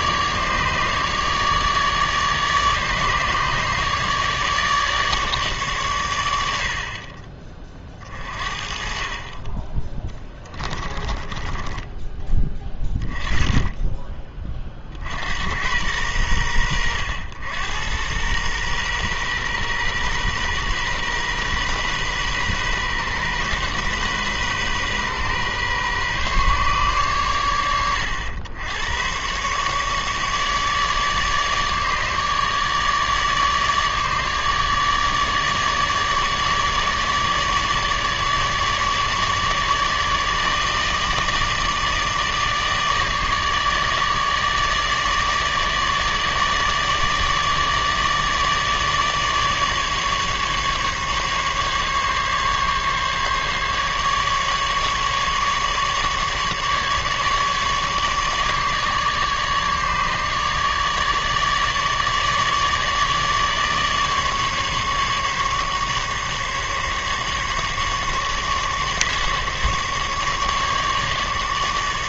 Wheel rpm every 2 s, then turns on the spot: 150, 150, 150, 70, 40, 20, 30, 40, 90, 120, 120, 130, 130, 130, 100, 150, 150, 150, 150, 150, 150, 150, 150, 150, 150, 150, 140, 150, 150, 150, 150, 150, 150, 150, 150, 140.
10-12